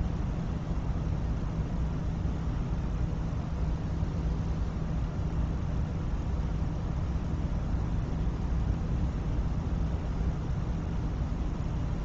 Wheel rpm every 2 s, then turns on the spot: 0, 0, 0, 0, 0, 0.
none